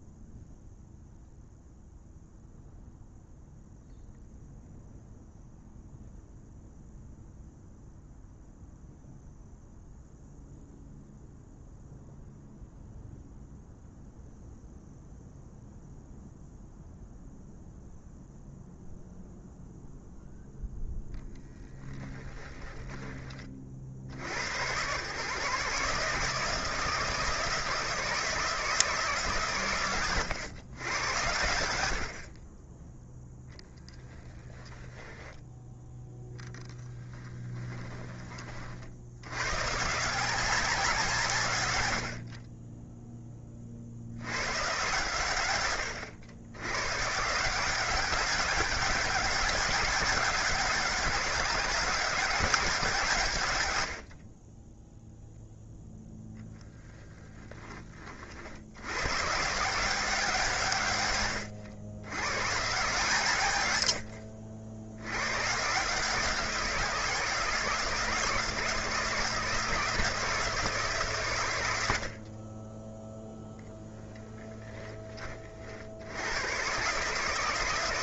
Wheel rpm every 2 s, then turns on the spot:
0, 0, 0, 0, 0, 0, 0, 0, 0, 0, 0, 20, 130, 160, 160, 110, 10, 10, 10, 50, 170, 30, 120, 130, 200, 190, 170, 10, 0, 100, 120, 150, 80, 170, 170, 140, 10, 20, 130.
34-38